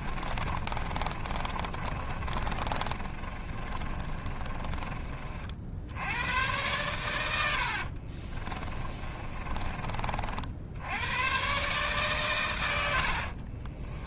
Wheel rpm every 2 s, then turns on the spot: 30, 30, 30, 110, 20, 80, 90.
0-4 8-10 12-14